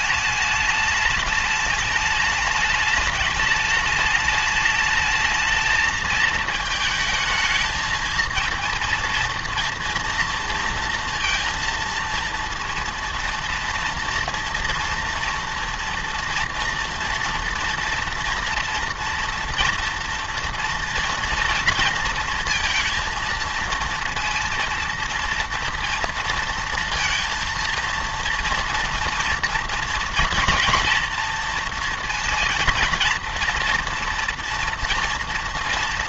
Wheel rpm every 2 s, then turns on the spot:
210, 210, 210, 220, 230, 230, 230, 230, 230, 230, 230, 230, 230, 230, 230, 230, 230, 230.
none